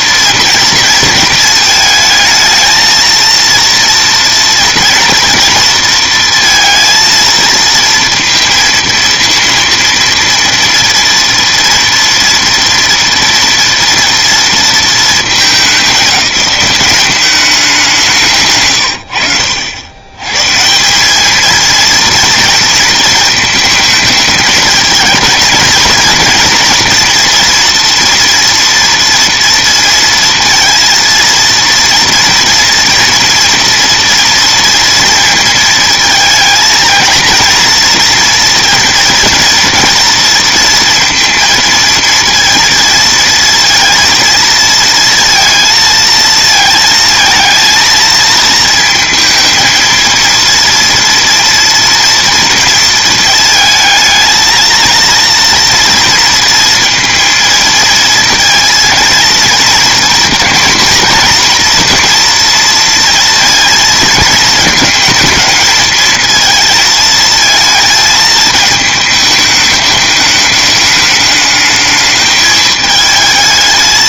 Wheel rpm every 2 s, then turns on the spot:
230, 220, 230, 230, 230, 230, 230, 230, 200, 120, 170, 230, 220, 230, 240, 230, 230, 230, 220, 230, 230, 230, 230, 220, 230, 230, 230, 230, 230, 230, 240, 230, 220, 230, 220, 210, 220.
none